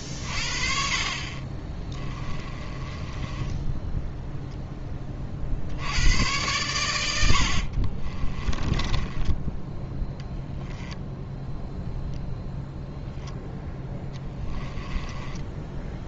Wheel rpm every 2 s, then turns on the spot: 40, 20, 10, 100, 20, 10, 0, 10.
2-4 8-10 14-16